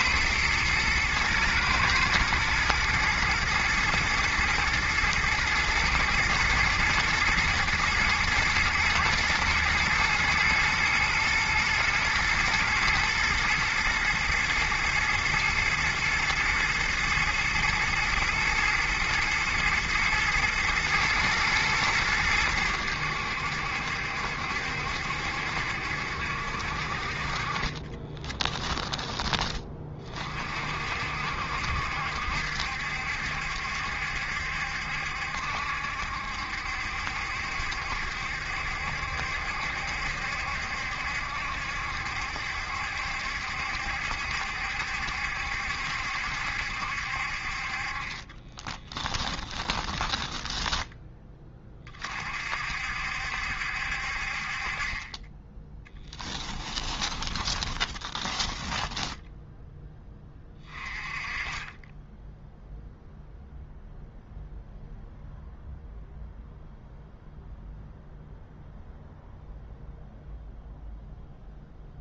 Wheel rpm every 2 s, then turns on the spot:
110, 110, 110, 120, 110, 110, 120, 120, 120, 110, 120, 90, 70, 50, 10, 50, 70, 70, 70, 70, 70, 70, 70, 70, 20, 10, 60, 30, 20, 10, 20, 0, 0, 0, 0, 0.
48-50 56-60